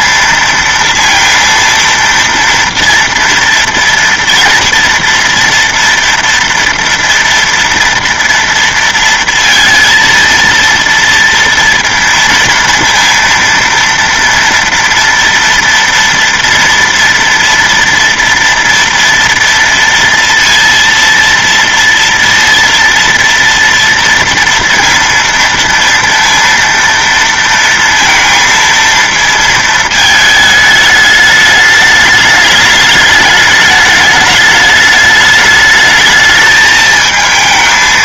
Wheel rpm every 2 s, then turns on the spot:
230, 230, 230, 240, 230, 230, 230, 230, 230, 240, 230, 230, 230, 230, 230, 210, 210, 210, 220.
none